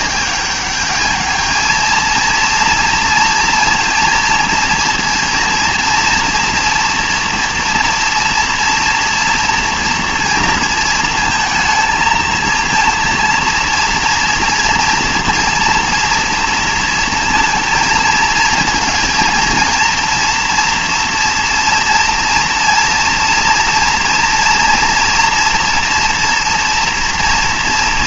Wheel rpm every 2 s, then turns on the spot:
210, 230, 230, 240, 230, 230, 230, 230, 230, 230, 230, 230, 230, 230.
none